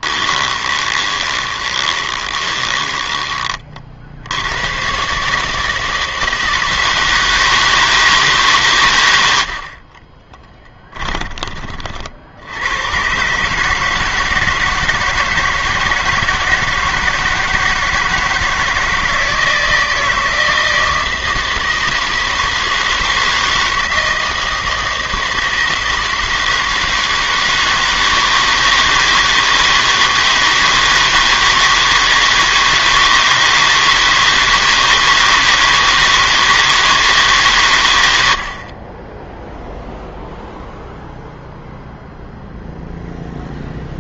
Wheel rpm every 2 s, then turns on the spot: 20, 20, 90, 160, 130, 20, 80, 160, 160, 160, 160, 160, 160, 160, 160, 160, 160, 160, 160, 70, 0, 0.
0-4 10-12